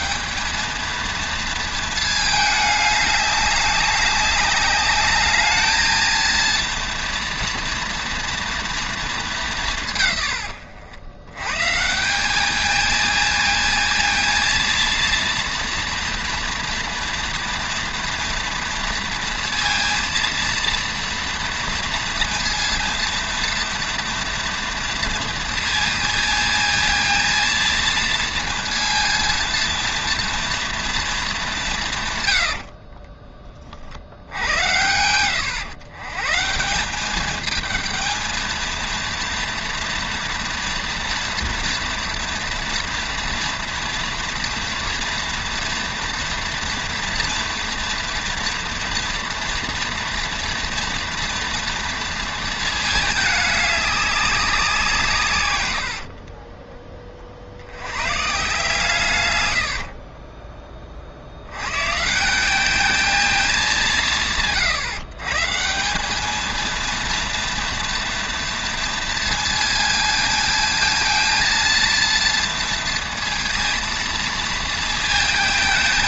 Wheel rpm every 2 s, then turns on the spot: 220, 210, 200, 240, 230, 80, 210, 230, 240, 240, 230, 230, 230, 230, 230, 240, 70, 90, 160, 220, 230, 230, 230, 230, 230, 230, 220, 180, 30, 150, 30, 210, 150, 220, 230, 230, 230, 230.
32-34